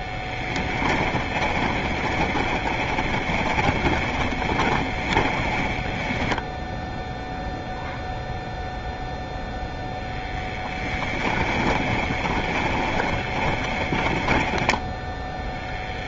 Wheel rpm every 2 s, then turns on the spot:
10, 20, 20, 20, 0, 10, 20, 20.
2-8 12-16